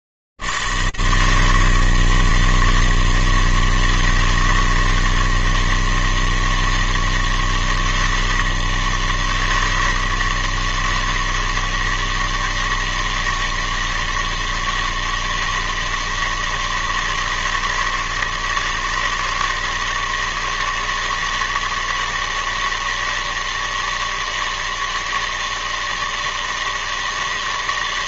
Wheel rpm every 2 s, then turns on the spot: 80, 160, 160, 160, 160, 160, 160, 160, 160, 160, 160, 160, 160, 160.
none